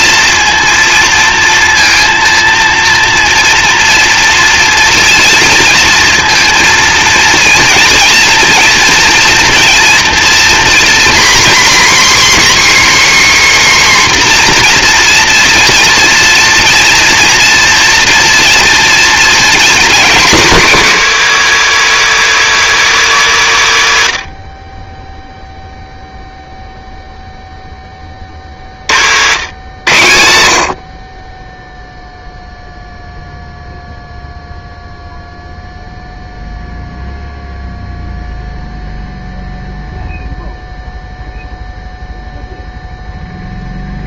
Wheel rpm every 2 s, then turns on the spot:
230, 230, 230, 230, 230, 240, 280, 260, 230, 230, 220, 150, 60, 0, 40, 70, 0, 0, 0, 0, 0, 0.
none